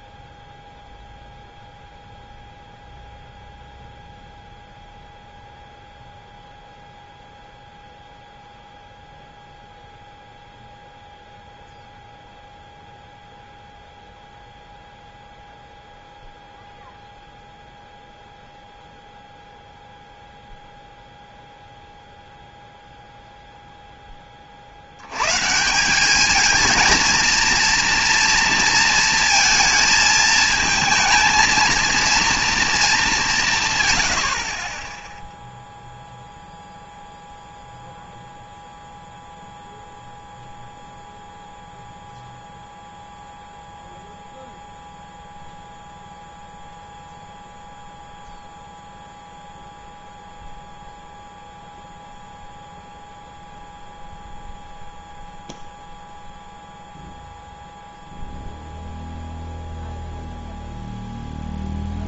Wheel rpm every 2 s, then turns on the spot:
0, 0, 0, 0, 0, 0, 0, 0, 0, 0, 0, 0, 40, 220, 230, 220, 230, 30, 0, 0, 0, 0, 0, 0, 0, 0, 0, 0, 0, 0, 0.
none